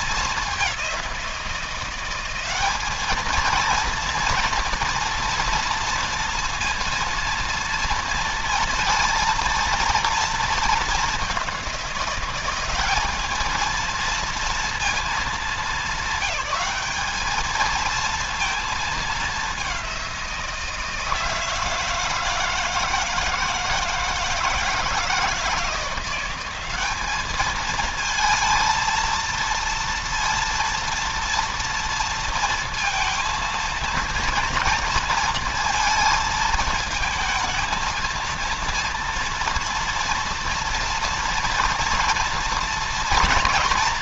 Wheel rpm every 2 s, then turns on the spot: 190, 220, 230, 230, 230, 210, 210, 220, 200, 210, 160, 160, 160, 200, 230, 230, 230, 230, 220, 230, 240, 230.
none